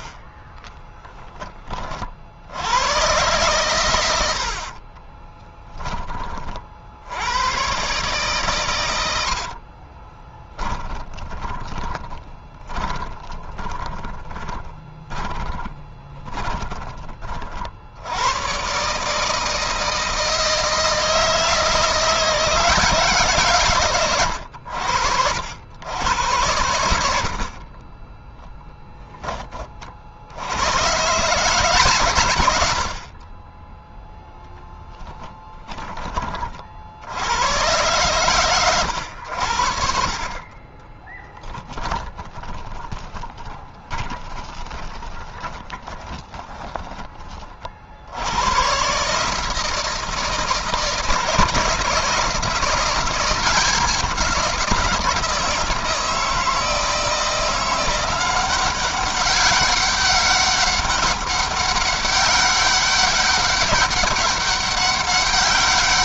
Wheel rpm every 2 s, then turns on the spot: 20, 100, 50, 60, 100, 30, 20, 20, 30, 140, 160, 150, 70, 90, 10, 120, 80, 10, 70, 110, 20, 10, 20, 20, 130, 160, 170, 170, 160, 190, 200, 200, 200.
0-2 4-6 10-16 34-36 40-46